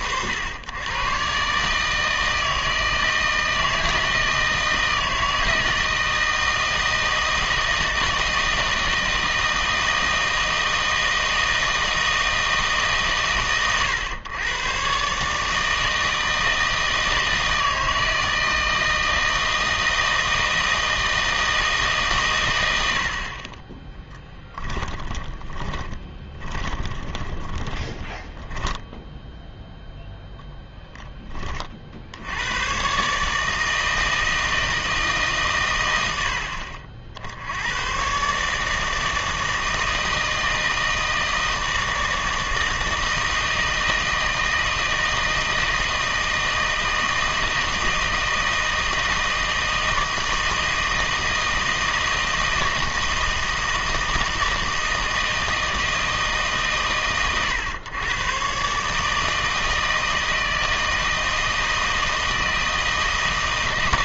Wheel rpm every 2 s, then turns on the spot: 100, 160, 160, 160, 160, 160, 160, 120, 160, 160, 160, 100, 10, 20, 10, 0, 110, 160, 50, 150, 160, 160, 160, 160, 160, 160, 160, 160, 140, 130, 160, 160.
24-28